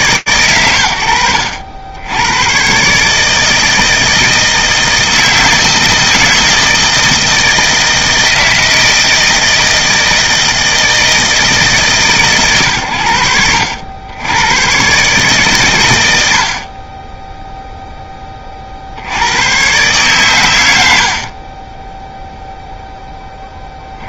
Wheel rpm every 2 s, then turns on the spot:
90, 130, 160, 160, 160, 160, 110, 130, 30, 60, 90, 0.
none